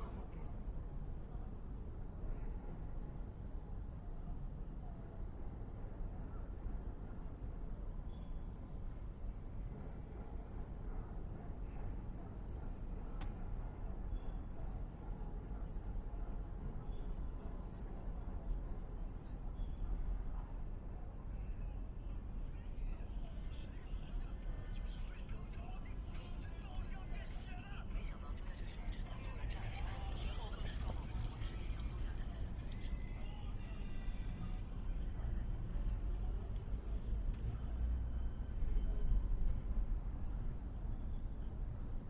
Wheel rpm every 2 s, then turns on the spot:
0, 0, 0, 0, 0, 0, 0, 0, 0, 0, 0, 0, 0, 0, 0, 0, 0, 0, 0, 0, 0.
none